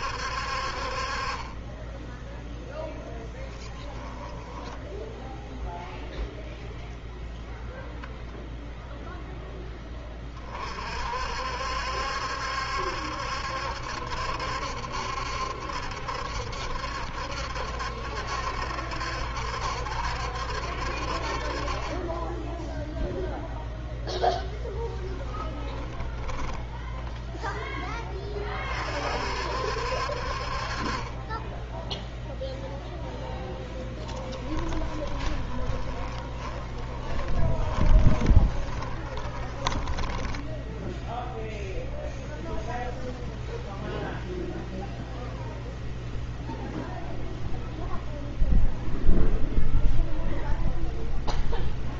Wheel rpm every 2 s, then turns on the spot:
40, 0, 10, 10, 10, 50, 70, 70, 70, 70, 60, 0, 20, 0, 40, 40, 0, 20, 20, 20, 10, 0, 0, 0, 0, 0.
4-6 24-26 34-40